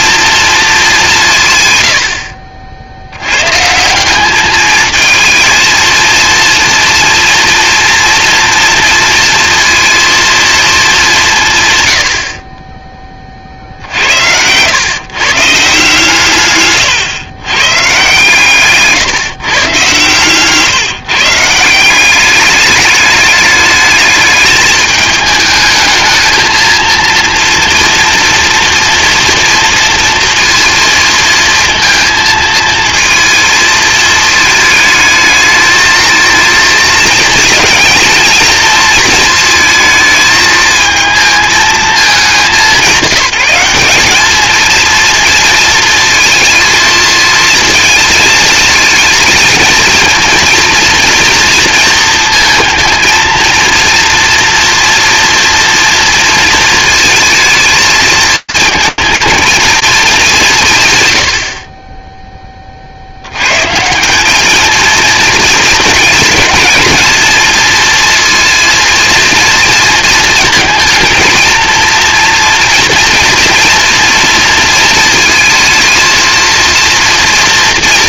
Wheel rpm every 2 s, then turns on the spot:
220, 70, 210, 230, 230, 220, 20, 110, 130, 140, 150, 210, 210, 230, 230, 230, 220, 220, 230, 230, 220, 190, 220, 230, 220, 230, 230, 230, 230, 220, 170, 40, 220, 220, 230, 220, 230, 220, 230.
16-18